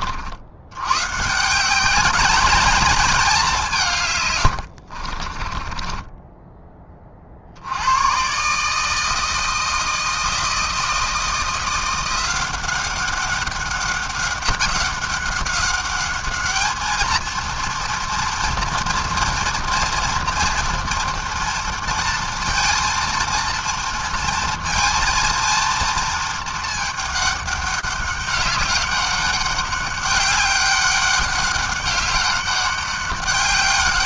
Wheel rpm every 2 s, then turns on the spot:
80, 210, 90, 20, 140, 160, 180, 190, 210, 230, 240, 230, 230, 220, 200, 200, 200.
4-6